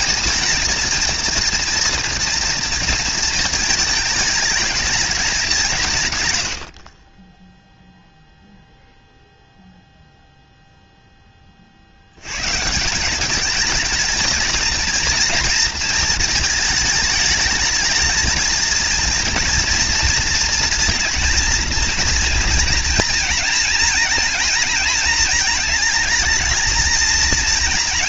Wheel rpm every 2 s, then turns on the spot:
230, 230, 220, 80, 0, 0, 150, 220, 220, 220, 230, 230, 230, 230.
none